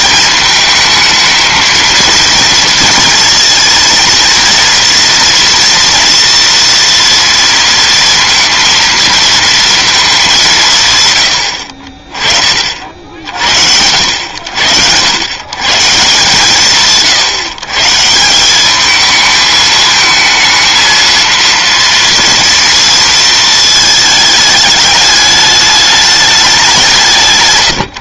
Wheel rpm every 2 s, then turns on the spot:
220, 230, 230, 230, 230, 170, 60, 100, 150, 200, 230, 230, 210, 190.
none